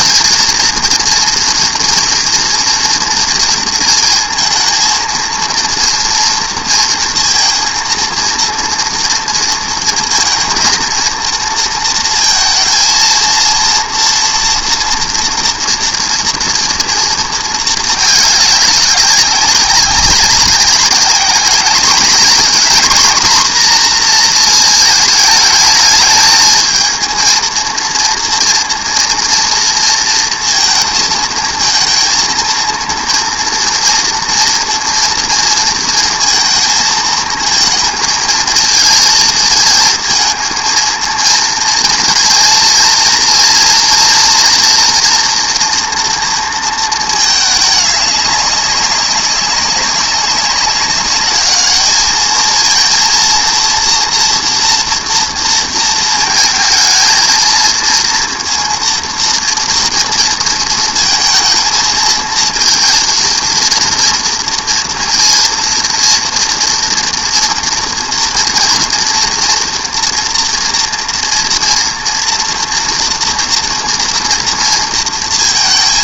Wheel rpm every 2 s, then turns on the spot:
230, 230, 230, 230, 230, 230, 230, 230, 230, 190, 190, 240, 220, 230, 230, 220, 230, 230, 220, 230, 230, 240, 230, 220, 200, 200, 230, 230, 230, 230, 230, 230, 230, 230, 230, 230, 230, 230.
none